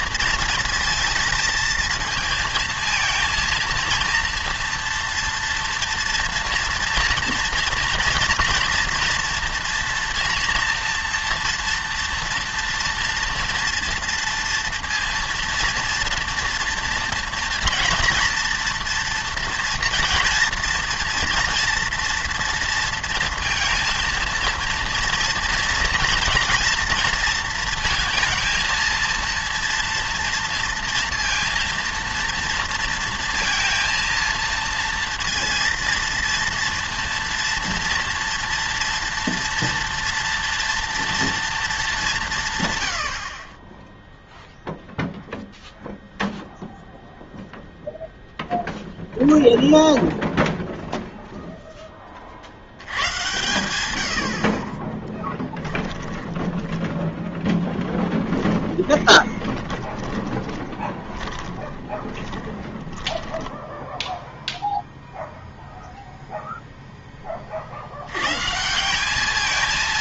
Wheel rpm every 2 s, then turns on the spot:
230, 230, 230, 240, 230, 230, 230, 230, 230, 230, 240, 230, 230, 230, 230, 230, 230, 230, 230, 240, 230, 130, 0, 0, 0, 0, 80, 40, 20, 20, 20, 20, 0, 0, 170.
56-64